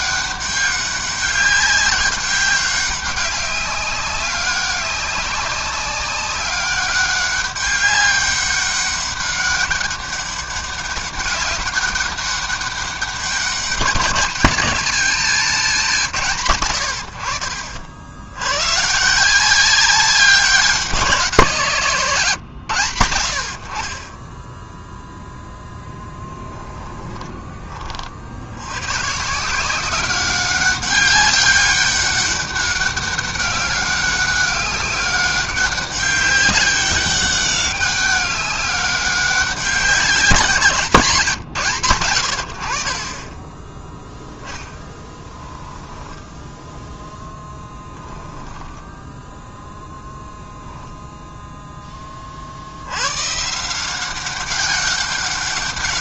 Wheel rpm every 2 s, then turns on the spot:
200, 200, 200, 200, 200, 200, 190, 210, 110, 140, 190, 100, 0, 10, 110, 200, 200, 200, 200, 200, 160, 40, 10, 0, 10, 0, 100, 200.
26-28 44-46 48-50